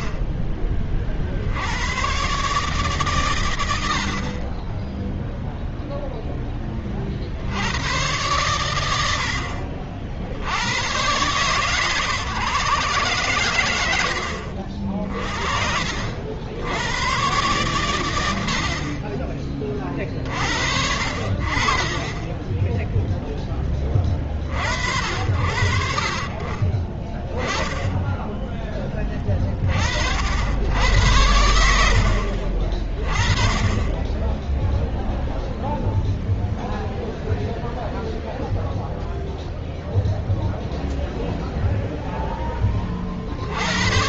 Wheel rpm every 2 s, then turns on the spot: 30, 140, 20, 20, 80, 100, 130, 60, 90, 60, 50, 10, 60, 30, 10, 80, 40, 0, 0, 0, 0, 20.
none